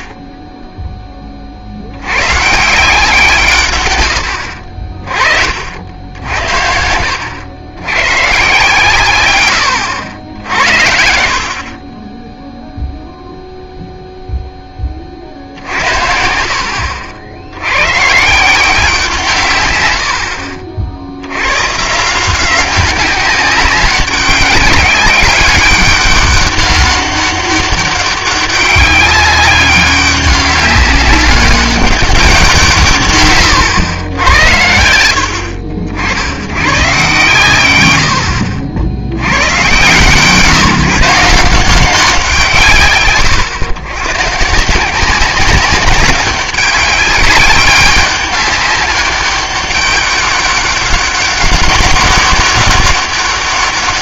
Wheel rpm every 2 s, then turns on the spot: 10, 140, 60, 70, 140, 70, 0, 10, 60, 170, 60, 180, 200, 200, 200, 200, 170, 80, 110, 70, 150, 140, 160, 190, 200, 200, 200.
4-6